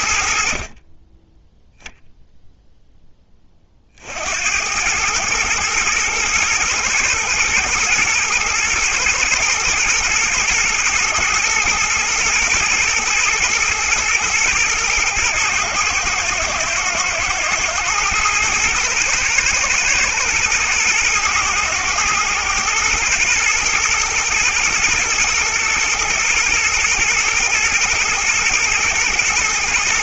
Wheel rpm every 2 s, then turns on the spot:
0, 40, 110, 110, 110, 120, 120, 110, 110, 110, 110, 110, 110, 120, 120.
none